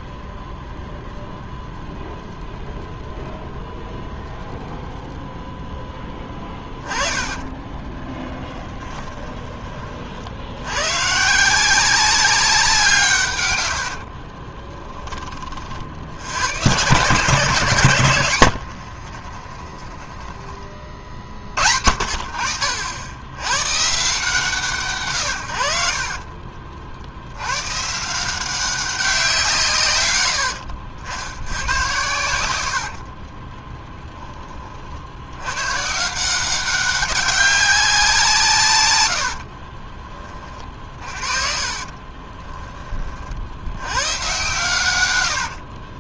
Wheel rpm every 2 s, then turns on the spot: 0, 0, 0, 20, 10, 110, 170, 20, 120, 80, 30, 80, 130, 50, 190, 70, 70, 60, 190, 110, 40, 20, 110.
6-10 18-20 32-34 40-42